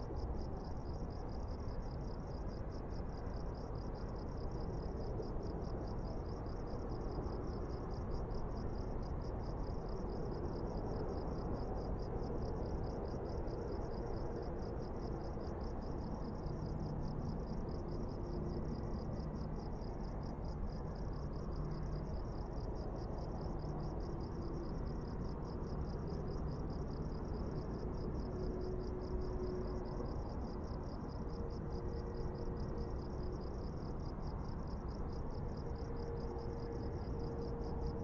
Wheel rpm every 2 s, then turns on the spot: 0, 0, 0, 0, 0, 0, 0, 0, 0, 0, 0, 0, 0, 0, 0, 0, 0, 0, 0.
none